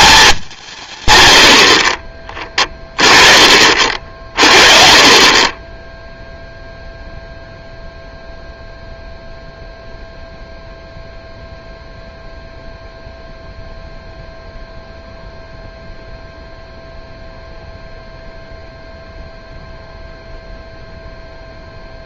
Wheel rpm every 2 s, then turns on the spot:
150, 20, 30, 0, 0, 0, 0, 0, 0, 0, 0.
none